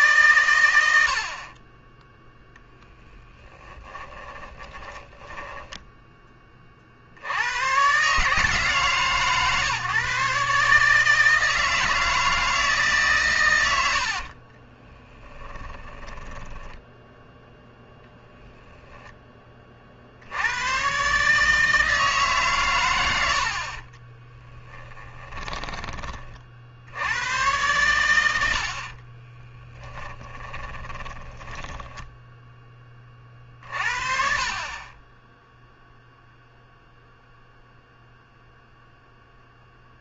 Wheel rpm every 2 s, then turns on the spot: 90, 0, 10, 40, 150, 150, 150, 20, 10, 10, 110, 120, 10, 60, 60, 20, 20, 30, 0, 0.
4-6 14-18 24-26 30-32